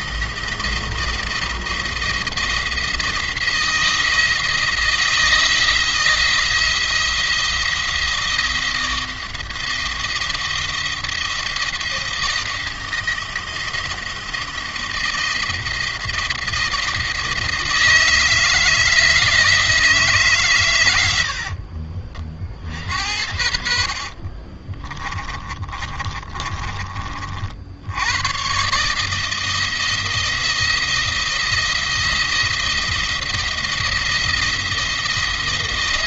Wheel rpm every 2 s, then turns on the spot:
170, 170, 160, 170, 170, 160, 170, 170, 170, 160, 110, 60, 40, 40, 140, 170, 170, 170.
20-26